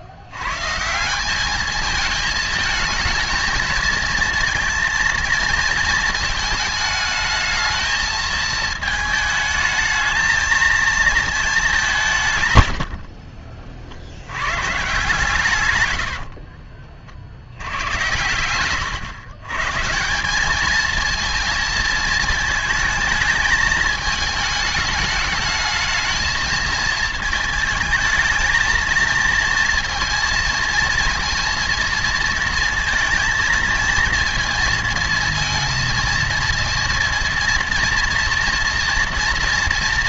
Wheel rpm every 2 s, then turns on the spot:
140, 220, 230, 220, 220, 230, 100, 120, 40, 110, 210, 220, 220, 220, 220, 230, 230, 230, 230, 240.
16-18